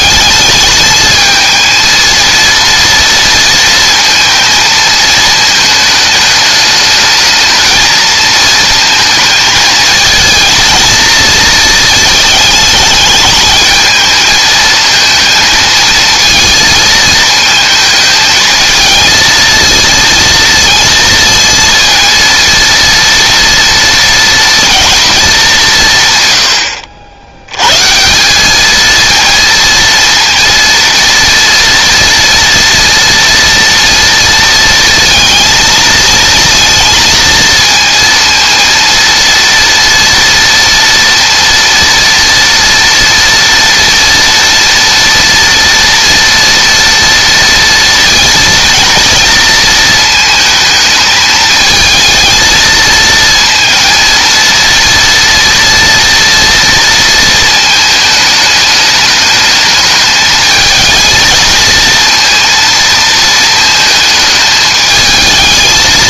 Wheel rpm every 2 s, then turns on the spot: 220, 230, 220, 220, 230, 220, 210, 230, 220, 220, 230, 230, 220, 70, 220, 230, 240, 230, 230, 230, 230, 230, 230, 230, 230, 220, 230, 230, 230, 210, 220, 230, 220.
none